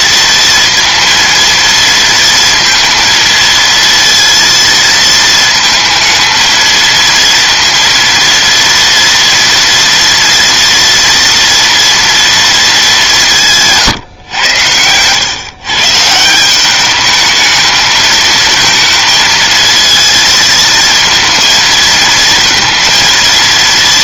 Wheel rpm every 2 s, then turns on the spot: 230, 230, 230, 230, 230, 230, 190, 110, 210, 230, 230, 230.
none